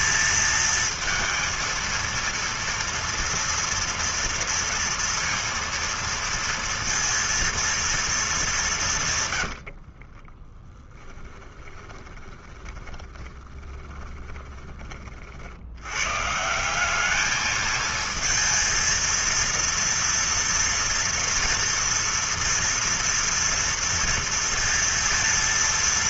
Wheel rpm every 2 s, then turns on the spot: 230, 230, 230, 230, 190, 20, 30, 20, 160, 230, 230, 230, 230.
10-16